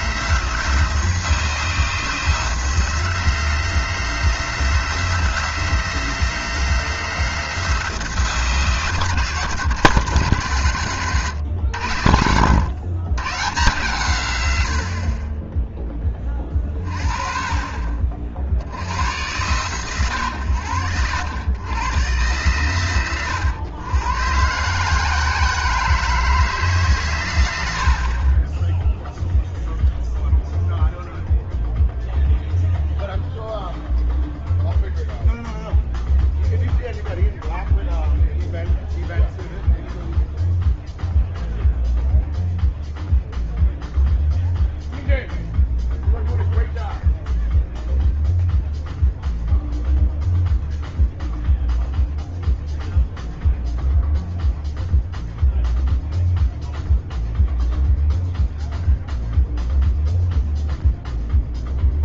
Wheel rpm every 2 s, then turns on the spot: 160, 160, 160, 160, 150, 120, 110, 60, 30, 80, 90, 110, 140, 130, 10, 0, 0, 0, 0, 0, 0, 0, 0, 0, 0, 0, 0, 0, 0, 0, 0.
none